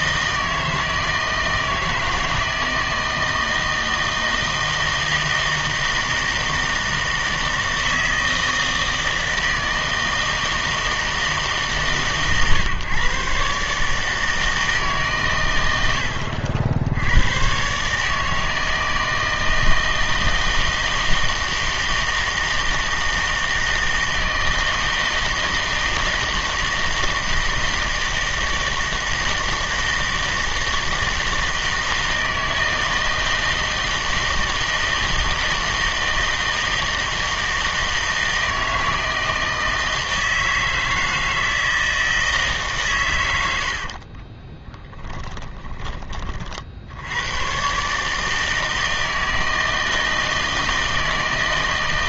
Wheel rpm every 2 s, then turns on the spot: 160, 160, 160, 160, 160, 160, 130, 150, 90, 160, 160, 160, 160, 160, 160, 160, 160, 160, 160, 160, 160, 130, 20, 70, 160, 160.
44-46